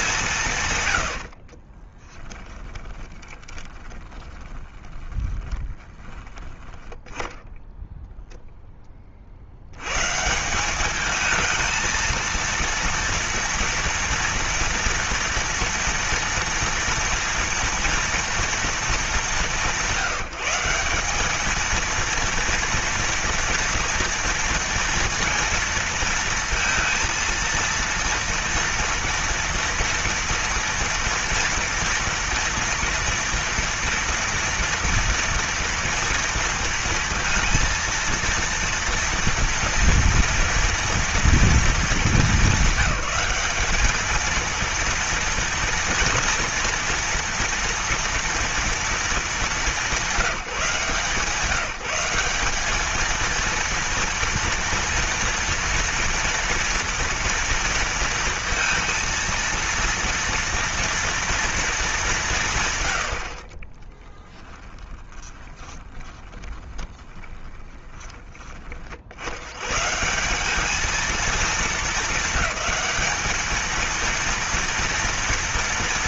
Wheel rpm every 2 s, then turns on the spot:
140, 10, 20, 10, 10, 180, 230, 230, 230, 230, 180, 230, 230, 230, 230, 230, 230, 230, 230, 230, 230, 200, 230, 230, 230, 170, 210, 230, 230, 230, 230, 130, 10, 20, 30, 200, 220, 230.
2-6 64-68